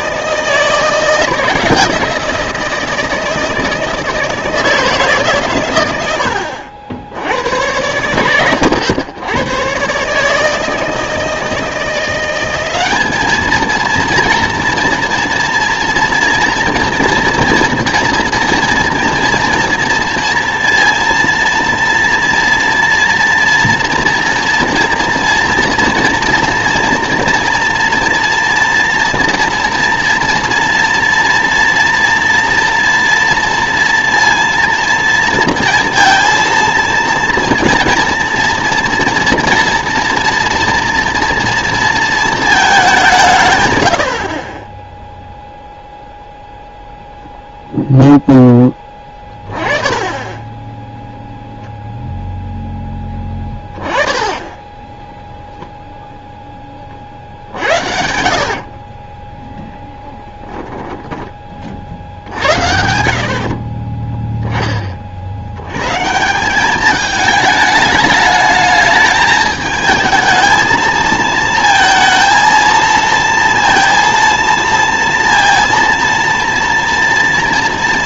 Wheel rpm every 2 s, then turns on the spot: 170, 170, 160, 70, 100, 160, 190, 230, 230, 230, 230, 230, 240, 230, 230, 230, 230, 230, 230, 240, 230, 210, 10, 0, 10, 0, 10, 10, 20, 50, 0, 80, 20, 200, 220, 220, 230, 230, 230.
44-46 58-60